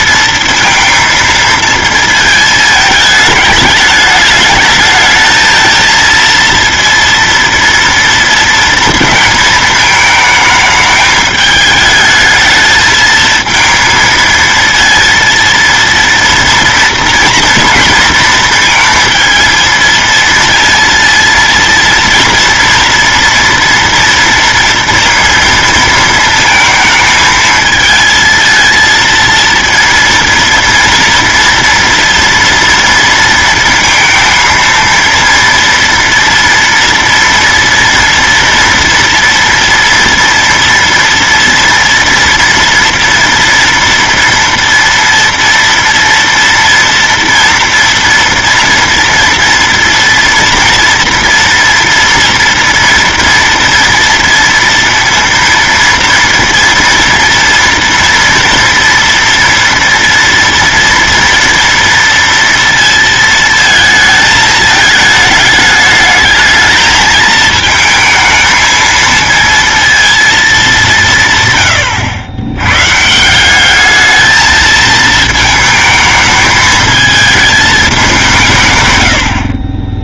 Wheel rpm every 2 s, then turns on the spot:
230, 210, 220, 230, 220, 220, 220, 230, 230, 230, 230, 230, 230, 220, 230, 230, 230, 230, 230, 230, 230, 230, 230, 230, 230, 240, 230, 230, 230, 230, 230, 230, 220, 220, 230, 170, 150, 220, 220, 100.
none